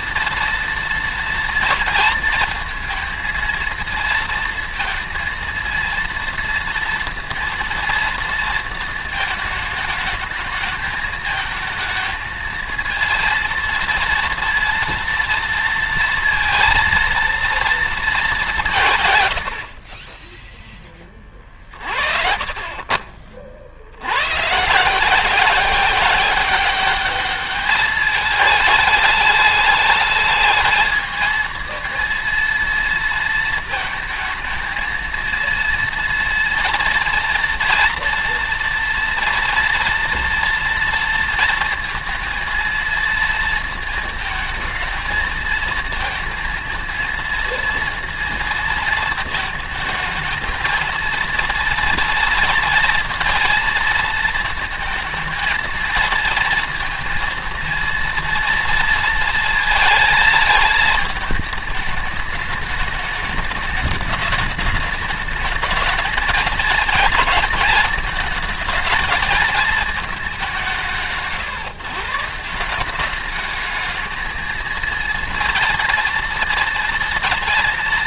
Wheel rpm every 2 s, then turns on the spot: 230, 220, 230, 230, 230, 220, 220, 230, 230, 170, 10, 30, 130, 200, 210, 210, 230, 220, 230, 230, 230, 230, 230, 230, 230, 220, 230, 230, 230, 230, 220, 210, 210, 230, 220, 180, 170, 230, 230.
none